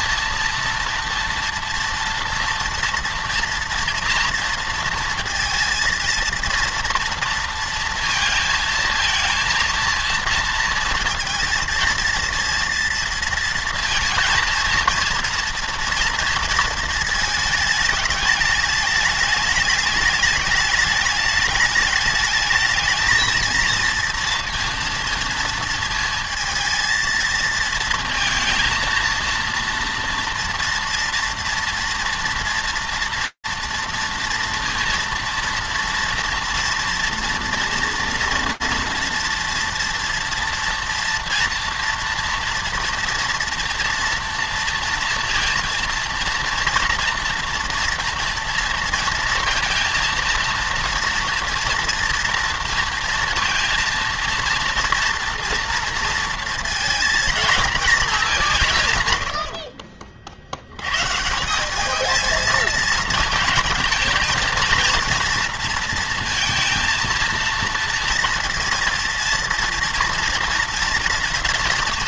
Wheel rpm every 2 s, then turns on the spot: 230, 230, 230, 230, 230, 230, 230, 230, 230, 210, 210, 220, 230, 230, 230, 240, 230, 230, 230, 230, 230, 240, 230, 230, 230, 230, 230, 230, 230, 130, 90, 230, 240, 230, 230, 240.
none